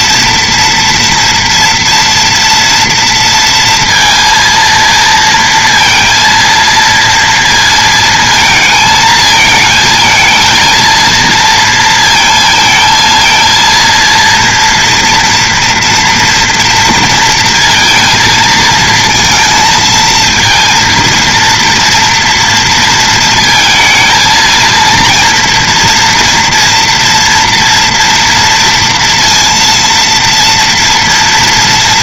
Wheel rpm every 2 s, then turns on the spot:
230, 230, 230, 230, 230, 230, 220, 230, 230, 230, 230, 230, 230, 230, 230, 230.
none